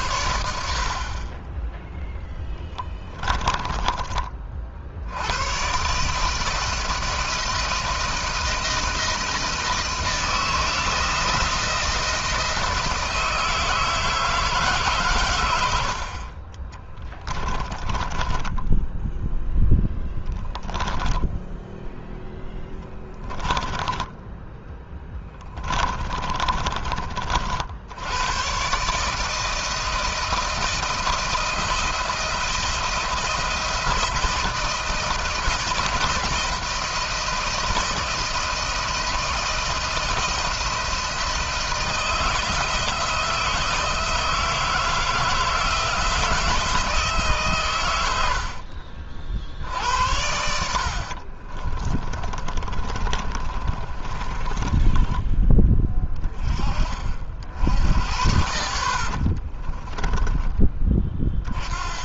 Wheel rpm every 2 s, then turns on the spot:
50, 10, 60, 160, 170, 160, 160, 140, 30, 10, 10, 10, 10, 30, 140, 160, 170, 170, 160, 160, 160, 160, 160, 160, 50, 50, 30, 20, 40, 60, 20.
2-4 16-20 22-26 50-56 58-60